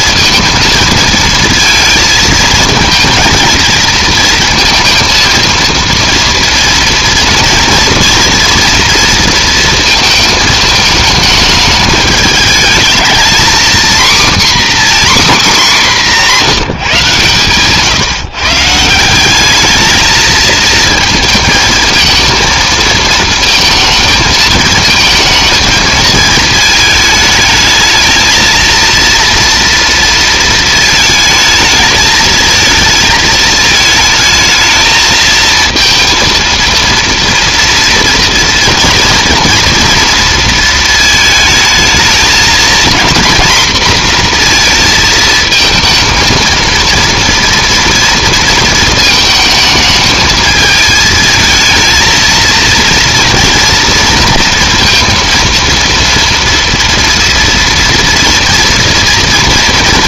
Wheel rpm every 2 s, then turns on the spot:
230, 230, 230, 230, 230, 220, 220, 270, 150, 160, 230, 230, 220, 220, 230, 220, 220, 220, 230, 230, 220, 240, 230, 230, 220, 220, 230, 230, 230, 230.
none